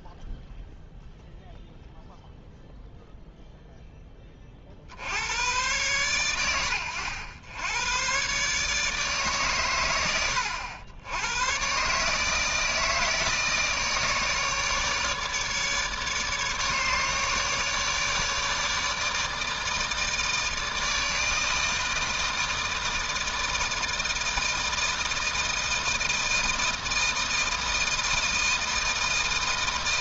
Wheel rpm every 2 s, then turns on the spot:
0, 0, 50, 100, 150, 90, 160, 150, 150, 150, 160, 160, 160, 160, 160.
none